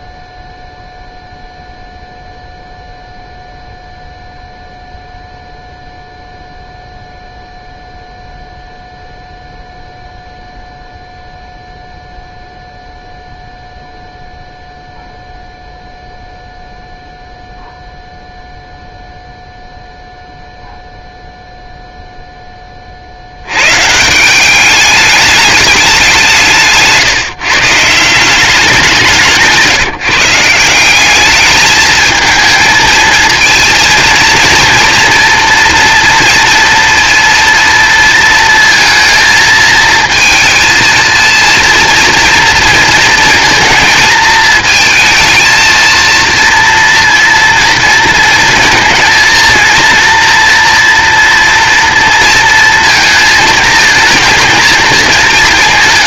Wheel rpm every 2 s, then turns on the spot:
0, 0, 0, 0, 0, 0, 0, 0, 0, 0, 0, 30, 210, 160, 190, 170, 220, 230, 230, 230, 220, 230, 220, 230, 230, 230, 230, 220.
none